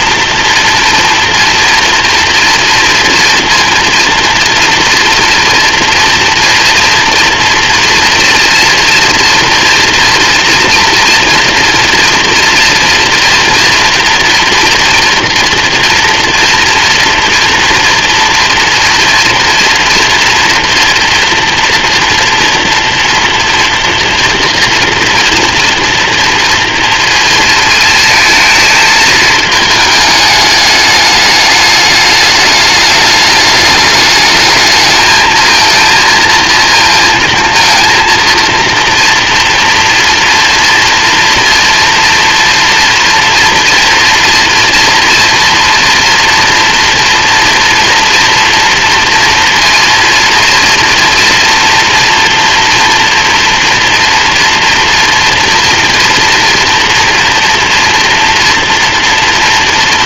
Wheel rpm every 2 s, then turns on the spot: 230, 230, 230, 230, 230, 240, 230, 240, 230, 230, 230, 230, 230, 230, 220, 210, 210, 220, 230, 240, 230, 230, 230, 230, 230, 230, 240, 230, 230, 240.
none